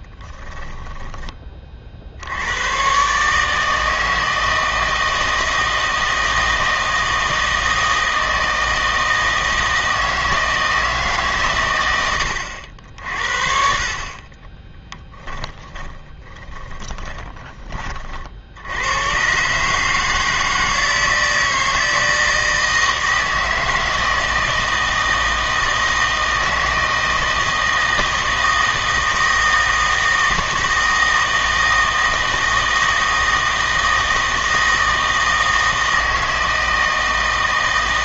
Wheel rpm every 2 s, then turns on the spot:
20, 110, 160, 160, 160, 160, 70, 20, 20, 80, 160, 160, 160, 160, 160, 160, 160, 160, 160.
0-2 14-18